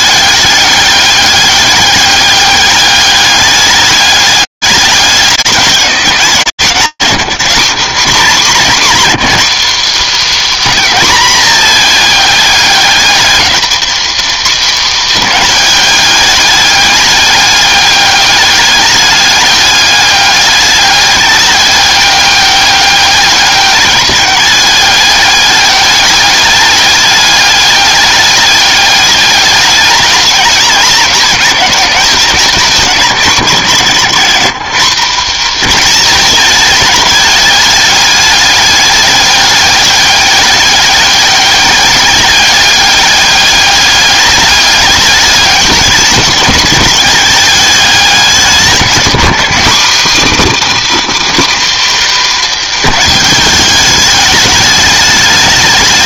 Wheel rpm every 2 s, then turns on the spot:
200, 200, 200, 180, 210, 260, 210, 230, 210, 200, 200, 200, 200, 210, 210, 210, 200, 140, 210, 200, 200, 200, 200, 200, 190, 200, 250, 210.
none